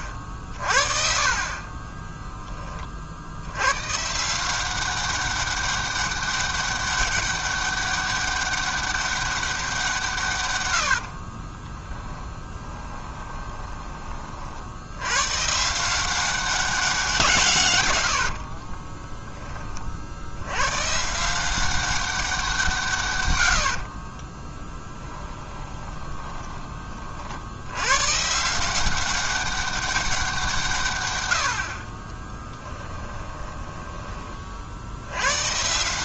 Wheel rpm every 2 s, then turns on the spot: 40, 30, 180, 200, 200, 110, 20, 60, 190, 40, 110, 170, 10, 20, 180, 150, 20, 50.
10-14 18-20 24-26 32-34